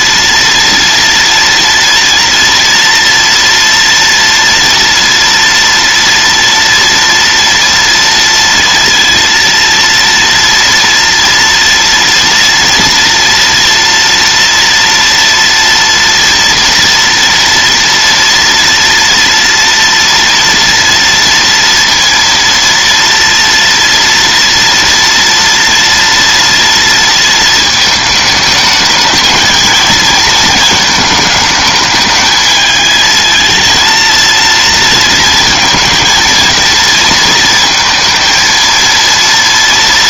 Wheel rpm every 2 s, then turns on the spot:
230, 230, 230, 230, 230, 230, 240, 240, 230, 230, 230, 230, 230, 230, 220, 220, 220, 230, 220, 230.
none